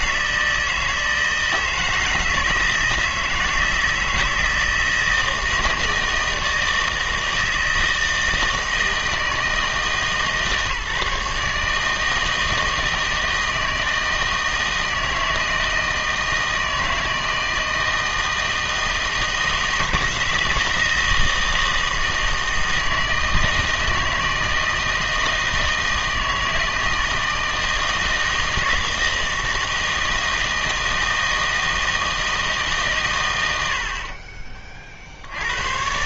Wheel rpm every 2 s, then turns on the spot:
160, 160, 160, 160, 160, 150, 160, 160, 160, 160, 160, 160, 160, 160, 160, 160, 150, 40.
none